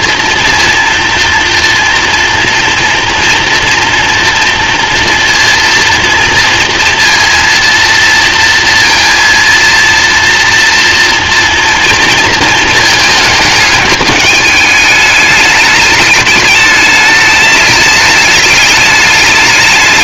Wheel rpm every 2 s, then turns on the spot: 240, 230, 230, 230, 230, 230, 220, 210, 210, 210.
none